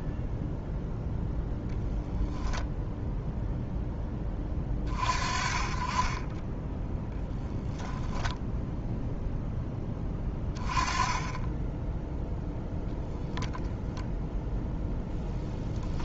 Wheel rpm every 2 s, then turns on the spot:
0, 0, 30, 10, 0, 20, 0, 0.
none